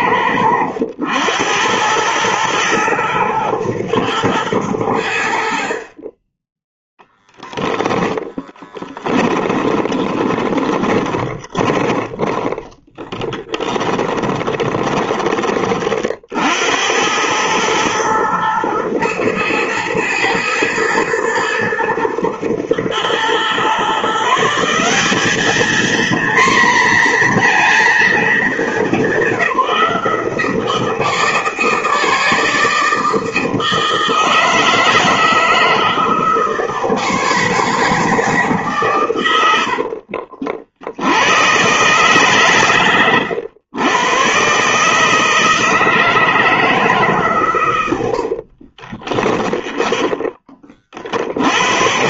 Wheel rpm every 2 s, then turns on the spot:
90, 110, 90, 10, 10, 20, 10, 20, 90, 110, 110, 110, 180, 240, 190, 160, 160, 160, 160, 140, 70, 120, 150, 160, 40, 40.
8-16 48-50